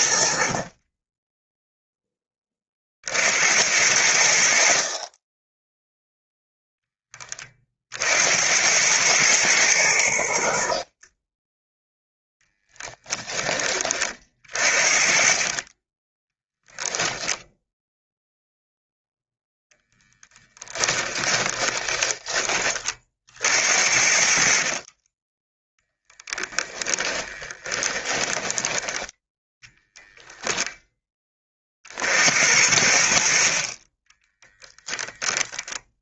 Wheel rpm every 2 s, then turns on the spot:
30, 40, 50, 10, 90, 40, 0, 40, 0, 0, 20, 30, 40, 10, 20, 0, 70, 10.
20-22 26-30